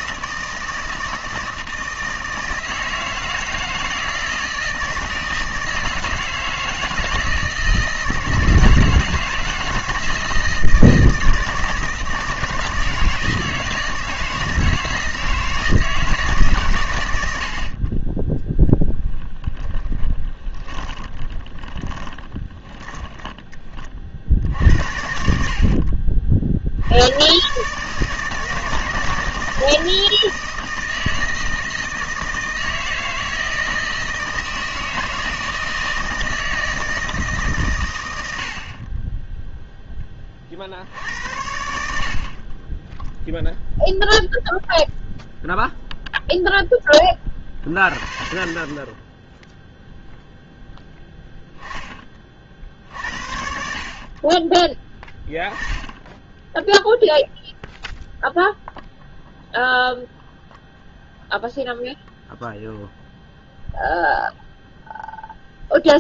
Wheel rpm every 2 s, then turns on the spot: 160, 160, 160, 160, 160, 160, 160, 160, 130, 0, 10, 10, 70, 70, 160, 160, 160, 160, 160, 40, 60, 10, 0, 10, 20, 0, 60, 10, 0, 0, 0, 0, 0.
20-24 42-44